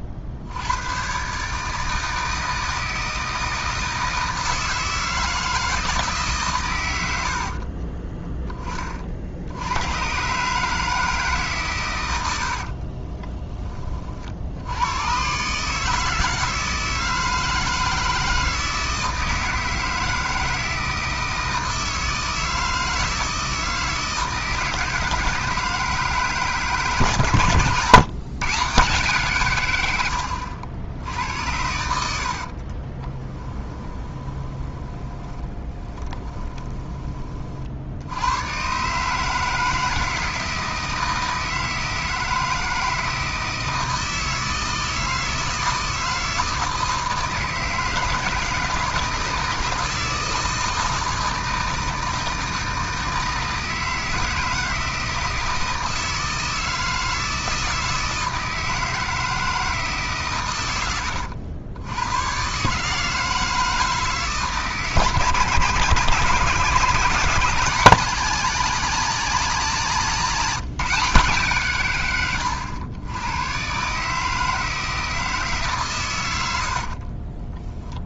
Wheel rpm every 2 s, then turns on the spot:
80, 160, 160, 130, 30, 150, 70, 80, 160, 160, 160, 160, 160, 140, 150, 80, 40, 20, 20, 120, 160, 160, 160, 160, 160, 160, 160, 160, 160, 160, 110, 140, 150, 160, 190, 180, 100, 160, 80.
12-14 32-38 76-78